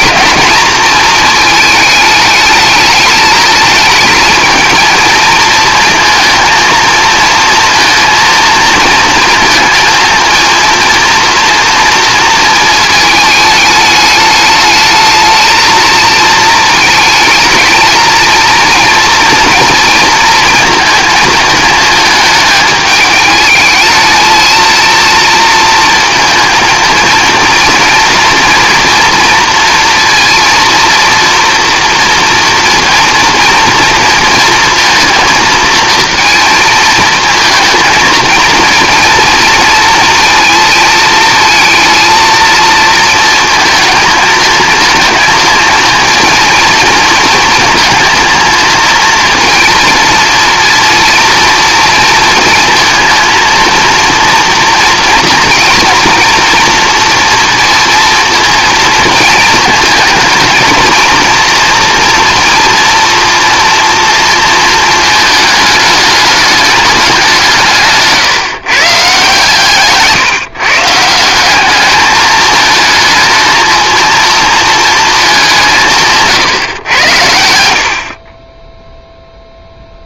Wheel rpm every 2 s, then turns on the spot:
230, 220, 220, 230, 230, 230, 220, 210, 220, 230, 230, 210, 230, 230, 230, 230, 230, 230, 230, 230, 230, 220, 220, 230, 230, 230, 230, 230, 230, 230, 230, 240, 230, 210, 140, 150, 220, 230, 120, 10.
none